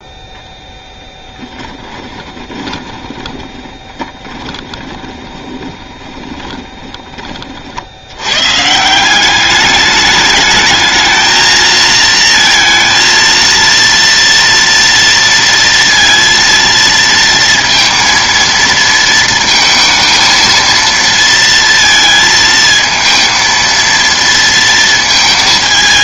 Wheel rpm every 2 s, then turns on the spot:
0, 20, 20, 10, 150, 220, 230, 230, 230, 230, 230, 230, 230.
2-6